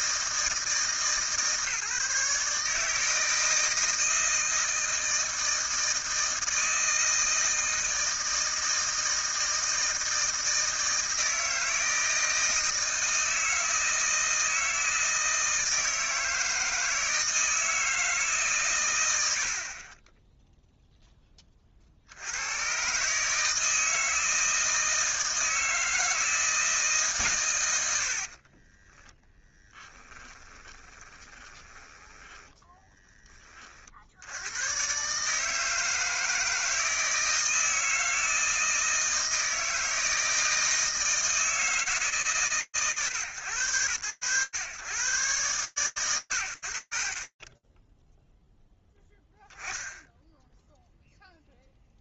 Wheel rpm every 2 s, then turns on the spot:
160, 150, 160, 160, 160, 160, 160, 160, 160, 140, 0, 100, 160, 160, 30, 20, 10, 100, 160, 160, 160, 120, 110, 80, 0, 0.
28-34